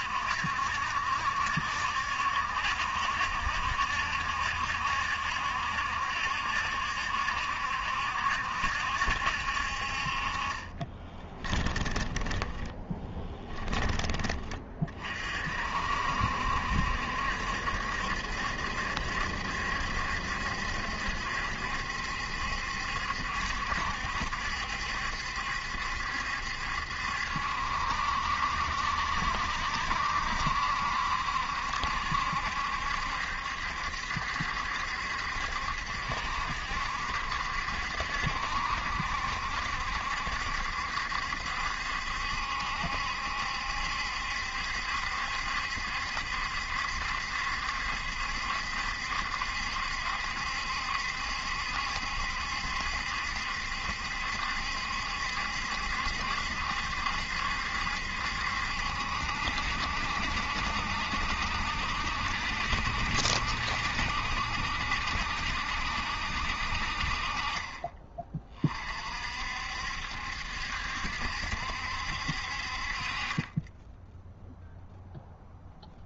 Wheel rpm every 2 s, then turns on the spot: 70, 70, 70, 70, 70, 30, 10, 40, 70, 70, 70, 70, 70, 70, 70, 70, 70, 70, 70, 70, 70, 70, 70, 70, 70, 70, 70, 70, 70, 70, 70, 70, 70, 60, 40, 70, 50, 0.
10-14